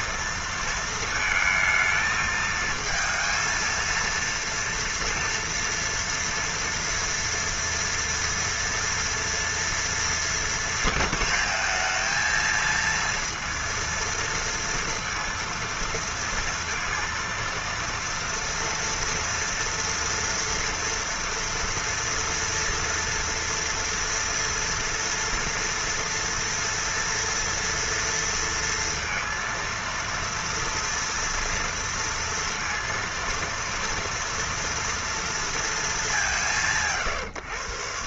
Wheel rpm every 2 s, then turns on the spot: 220, 220, 230, 230, 230, 230, 230, 230, 230, 230, 230, 240, 230, 230, 230, 230, 230, 230, 140.
none